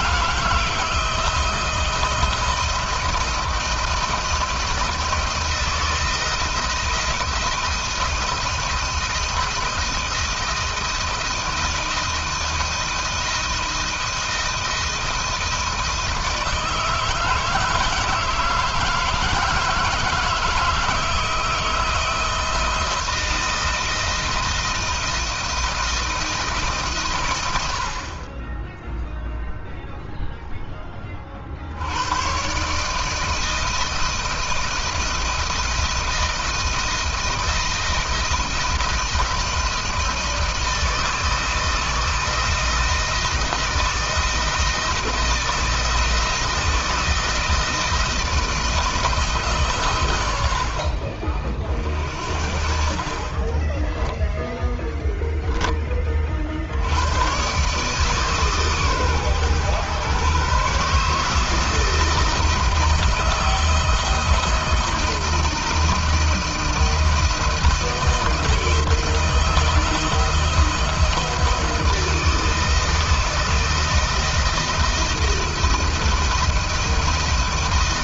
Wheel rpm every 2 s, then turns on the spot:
160, 170, 170, 170, 170, 160, 160, 160, 160, 160, 160, 160, 170, 150, 10, 10, 130, 160, 160, 160, 160, 160, 170, 170, 160, 70, 60, 10, 70, 140, 140, 160, 160, 160, 160, 160, 160, 160, 160.
none